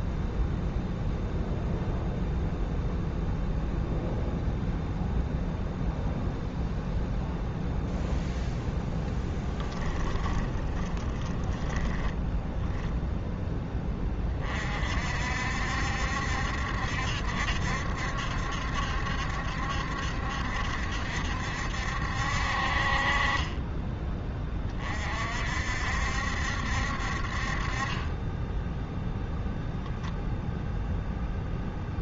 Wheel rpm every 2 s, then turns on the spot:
0, 0, 0, 0, 0, 10, 0, 50, 70, 70, 70, 40, 40, 60, 0, 0.
10-12